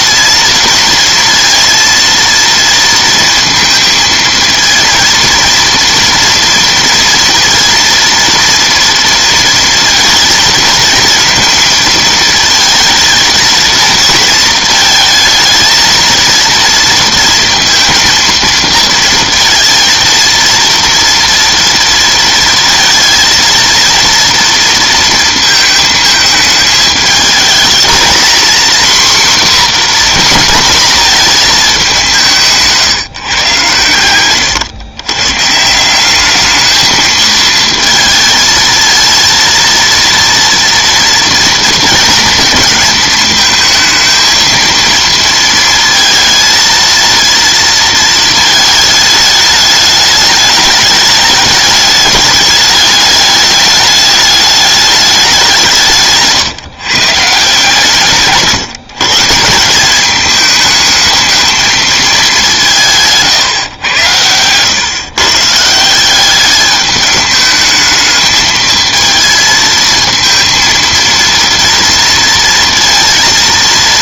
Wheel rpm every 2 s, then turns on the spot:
230, 230, 230, 230, 230, 220, 230, 230, 230, 230, 230, 230, 230, 210, 240, 240, 150, 120, 220, 220, 230, 230, 220, 220, 220, 210, 210, 210, 140, 140, 210, 170, 120, 210, 220, 230, 230.
none